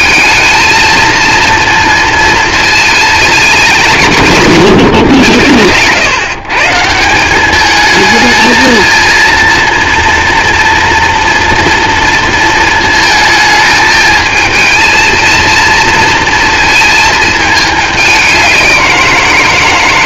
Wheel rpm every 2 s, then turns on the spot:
220, 230, 150, 160, 230, 230, 220, 220, 220, 180.
none